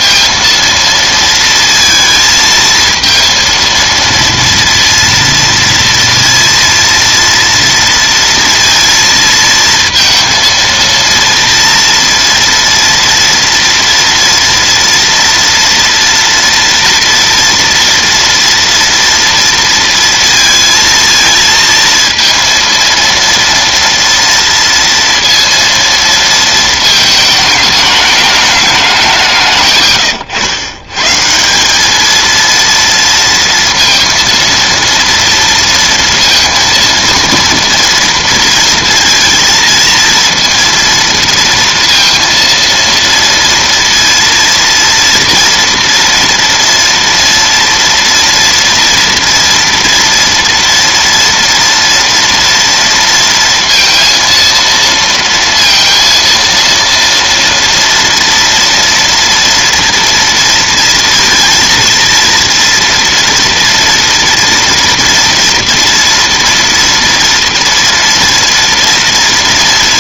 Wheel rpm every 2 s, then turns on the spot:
230, 230, 230, 230, 230, 220, 230, 230, 230, 230, 230, 230, 230, 220, 200, 120, 230, 230, 230, 230, 230, 230, 230, 240, 230, 230, 230, 230, 230, 230, 230, 230, 230, 230, 230.
none